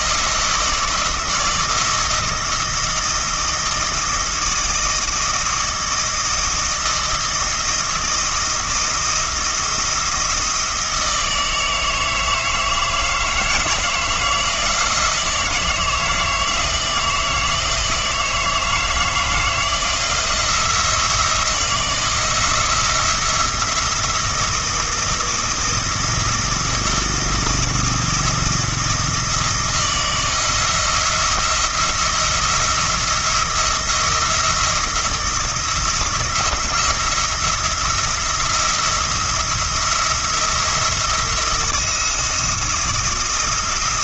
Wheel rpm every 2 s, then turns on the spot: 160, 160, 160, 160, 170, 160, 160, 170, 160, 160, 170, 170, 160, 160, 160, 170, 170, 170, 170, 170, 170, 170.
none